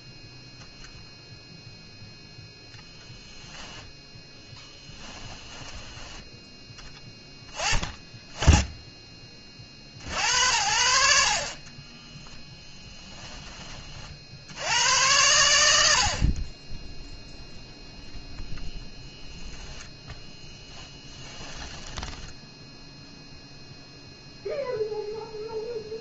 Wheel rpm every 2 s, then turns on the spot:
0, 0, 10, 10, 20, 80, 10, 90, 10, 10, 20, 0, 0.
4-6 12-14 20-22